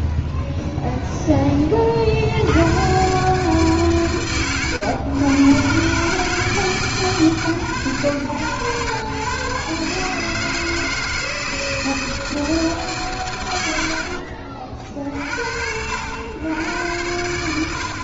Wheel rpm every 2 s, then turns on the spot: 90, 110, 160, 100, 150, 160, 50, 100, 0.
12-14